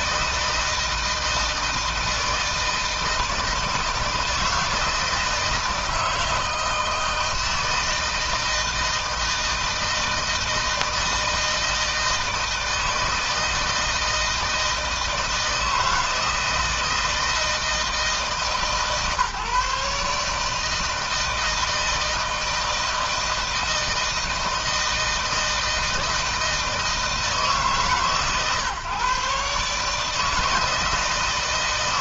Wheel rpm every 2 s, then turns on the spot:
160, 160, 160, 160, 160, 160, 160, 160, 160, 150, 160, 160, 160, 160, 130, 160.
none